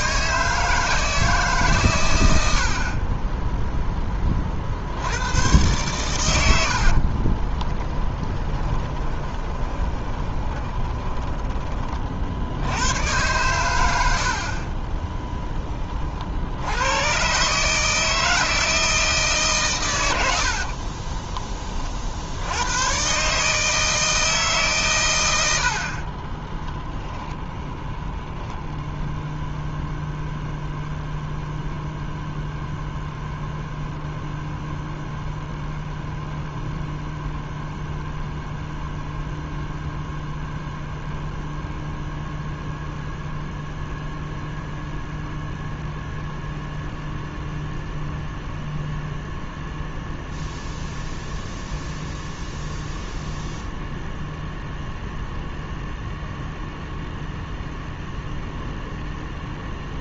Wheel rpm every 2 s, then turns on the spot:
160, 40, 50, 60, 30, 20, 100, 20, 100, 160, 40, 110, 130, 10, 0, 0, 0, 0, 0, 0, 0, 0, 0, 0, 0, 0, 0, 0, 0, 0.
6-12 20-22 26-28